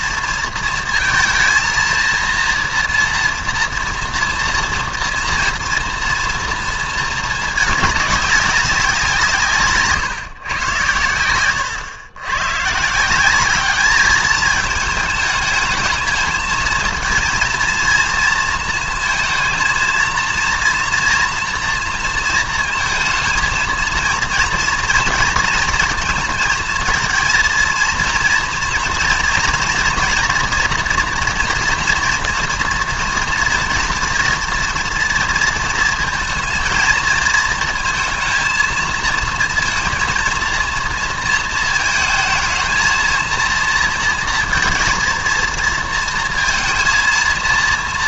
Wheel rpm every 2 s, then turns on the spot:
230, 230, 230, 230, 200, 110, 130, 210, 220, 230, 230, 220, 230, 220, 230, 240, 240, 230, 220, 220, 230, 220, 230, 230.
none